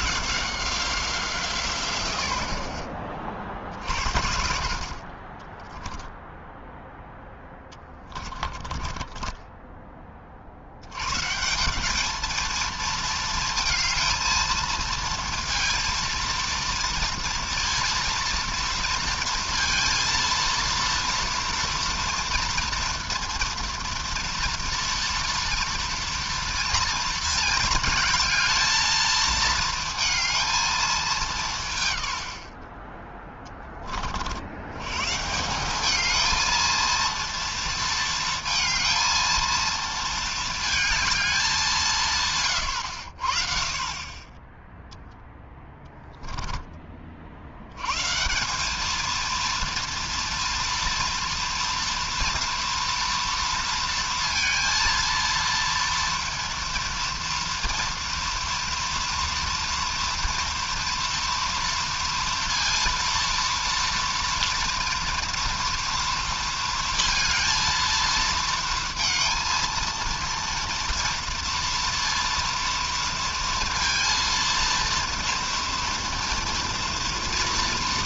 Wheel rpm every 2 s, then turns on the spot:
190, 60, 60, 0, 30, 60, 230, 230, 230, 230, 230, 230, 240, 230, 220, 220, 50, 90, 220, 230, 220, 130, 10, 10, 190, 230, 230, 230, 230, 230, 230, 230, 230, 230, 230, 230, 230, 230, 230.
8-10 42-44